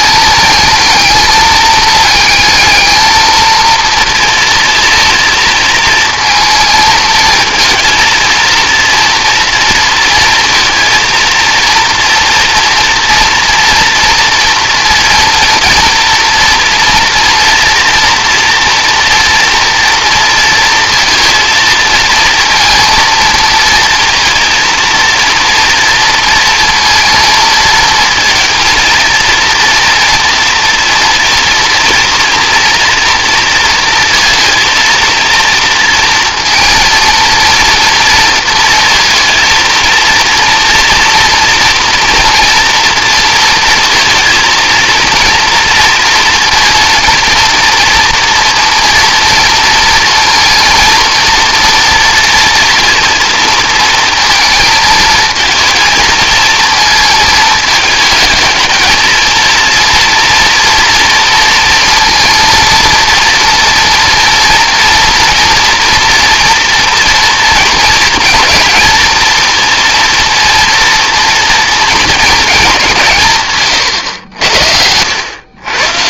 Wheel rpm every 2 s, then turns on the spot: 220, 220, 230, 230, 230, 230, 230, 230, 230, 230, 230, 230, 230, 230, 230, 230, 230, 230, 230, 230, 240, 230, 230, 230, 230, 230, 230, 220, 220, 220, 240, 230, 240, 230, 230, 230, 180, 80.
none